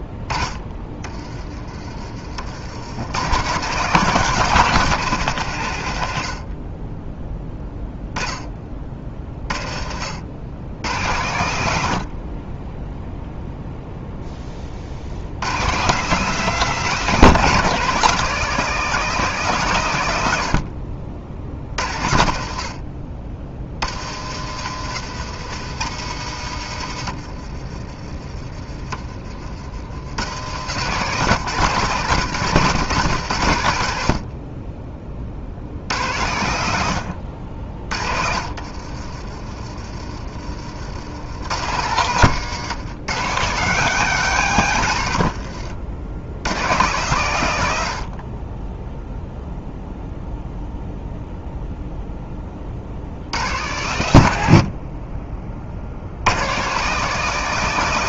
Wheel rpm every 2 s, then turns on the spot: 60, 70, 170, 50, 20, 100, 20, 30, 170, 190, 70, 60, 90, 100, 30, 100, 130, 30, 90, 50, 60, 140, 140, 120, 20, 0, 40, 70, 150.
38-40